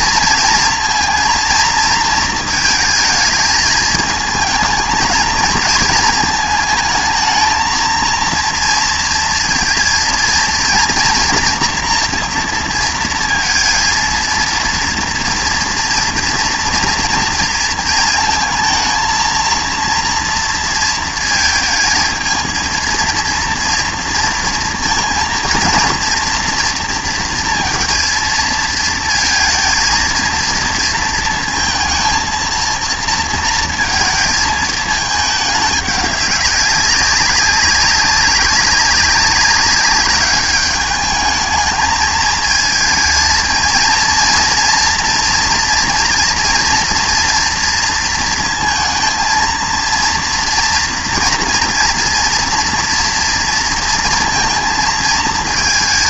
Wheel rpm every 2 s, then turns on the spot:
230, 220, 220, 220, 230, 230, 230, 230, 230, 230, 230, 230, 230, 230, 230, 230, 230, 220, 200, 200, 210, 220, 230, 240, 230, 230, 230, 230.
none